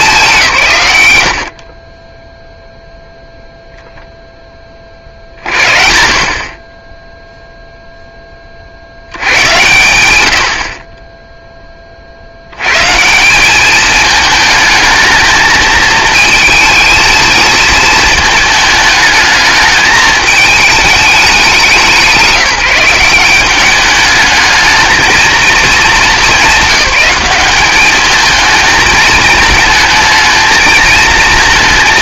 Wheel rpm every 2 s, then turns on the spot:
140, 0, 20, 20, 60, 60, 110, 220, 230, 220, 220, 180, 220, 200, 220, 220.
none